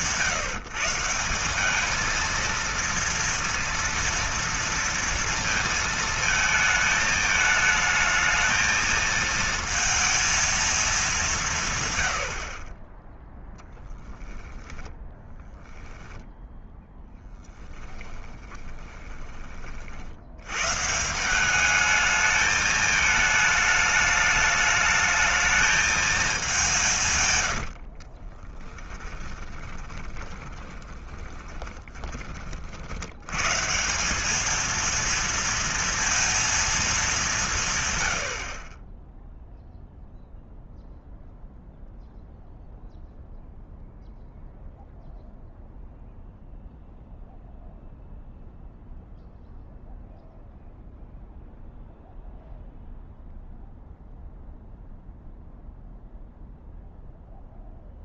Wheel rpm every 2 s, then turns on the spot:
180, 230, 230, 220, 220, 220, 30, 10, 10, 10, 120, 220, 210, 180, 20, 20, 70, 220, 220, 30, 0, 0, 0, 0, 0, 0, 0, 0, 0.
16-20 28-32